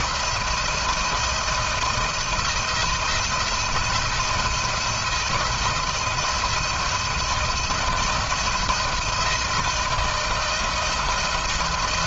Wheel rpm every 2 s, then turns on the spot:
170, 170, 160, 170, 170, 170.
none